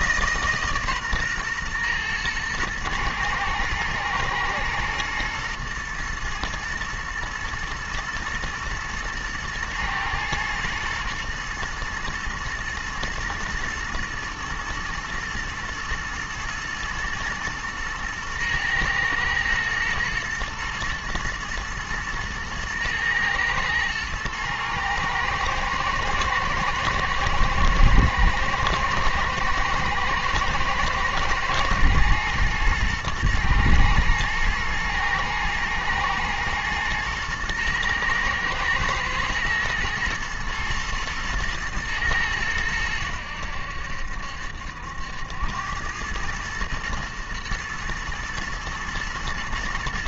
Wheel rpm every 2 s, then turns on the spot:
140, 110, 110, 110, 110, 110, 110, 110, 110, 110, 110, 110, 110, 110, 110, 110, 110, 110, 120, 120, 110, 100, 70, 110, 110.
none